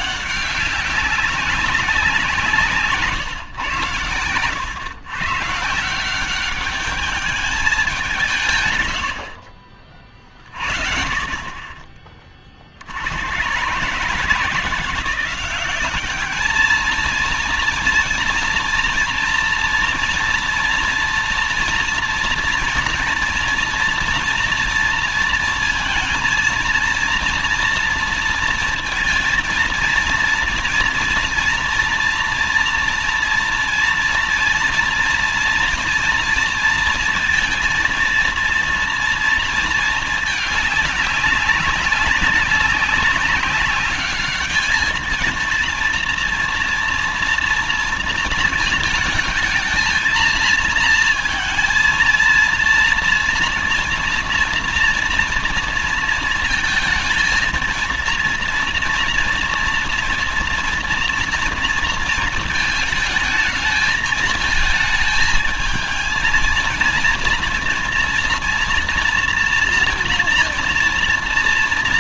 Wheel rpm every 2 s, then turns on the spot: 200, 170, 100, 190, 160, 40, 50, 160, 210, 240, 230, 230, 230, 230, 230, 230, 230, 230, 230, 230, 210, 190, 210, 230, 220, 220, 230, 230, 230, 230, 230, 220, 220, 230, 230, 230.
none